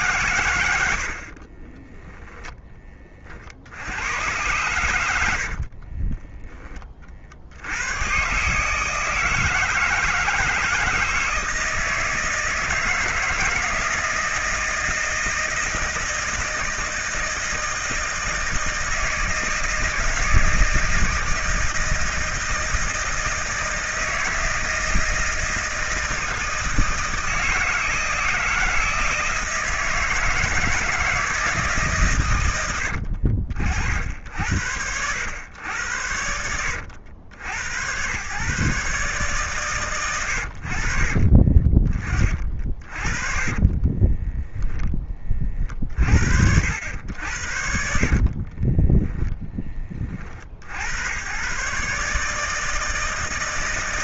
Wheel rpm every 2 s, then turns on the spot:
110, 20, 110, 20, 140, 160, 160, 160, 160, 160, 160, 160, 160, 160, 160, 160, 100, 70, 80, 130, 80, 40, 10, 60, 30, 60, 150.
42-46 48-50